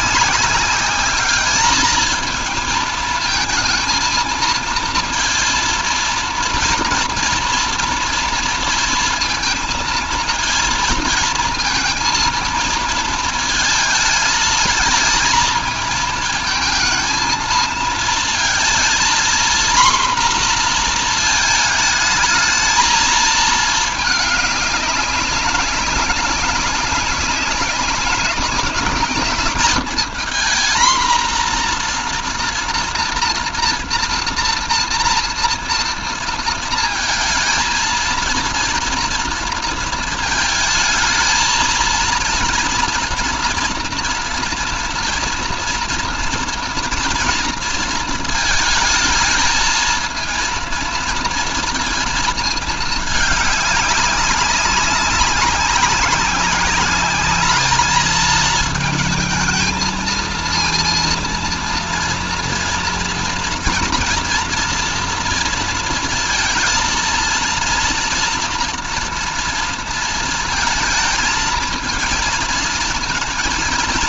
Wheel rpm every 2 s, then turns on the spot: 210, 220, 220, 230, 230, 230, 220, 220, 230, 230, 230, 220, 200, 200, 210, 230, 230, 230, 230, 230, 220, 230, 230, 230, 220, 230, 220, 190, 200, 220, 230, 230, 230, 230, 230, 220, 230.
none